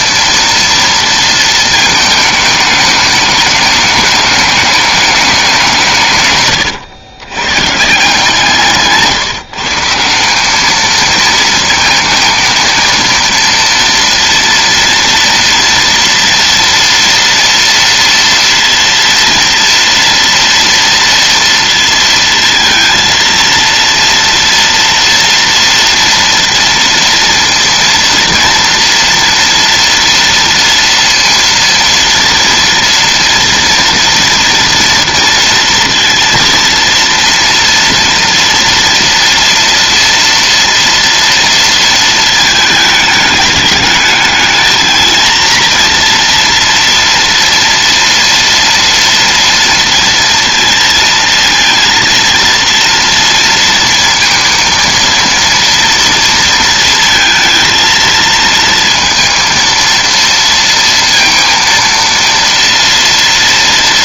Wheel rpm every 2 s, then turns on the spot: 230, 210, 210, 110, 150, 220, 230, 230, 230, 230, 230, 230, 230, 230, 230, 230, 230, 240, 230, 230, 230, 210, 220, 230, 230, 230, 230, 230, 230, 230, 230, 230.
8-10